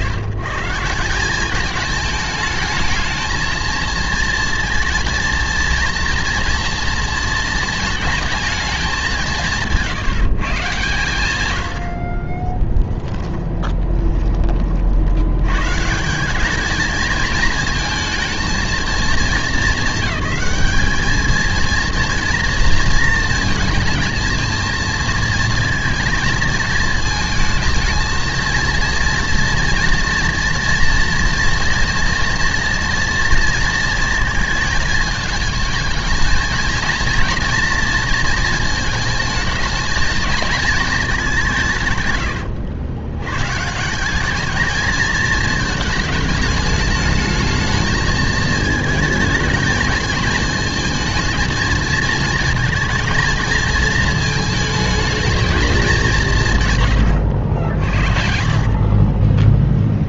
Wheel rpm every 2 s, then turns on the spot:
140, 220, 230, 230, 220, 150, 10, 30, 200, 220, 200, 230, 220, 220, 230, 240, 240, 220, 220, 230, 230, 80, 210, 210, 230, 220, 220, 220, 150, 60.
58-60